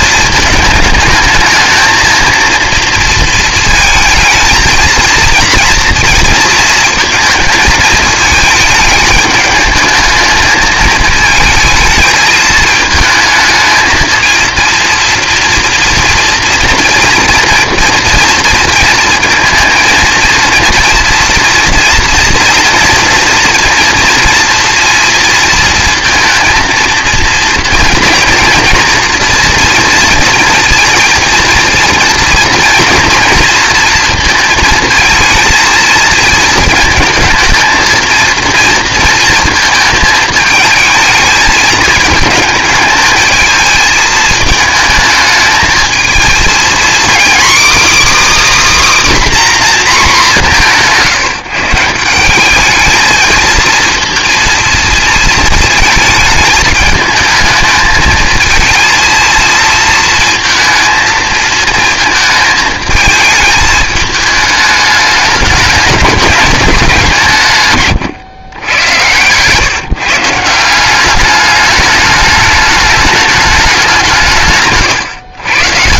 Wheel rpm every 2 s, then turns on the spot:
220, 230, 230, 230, 220, 220, 220, 230, 230, 230, 230, 230, 230, 230, 230, 230, 230, 220, 220, 230, 220, 220, 220, 240, 300, 180, 210, 230, 220, 220, 220, 220, 210, 190, 110, 180, 210, 140.
none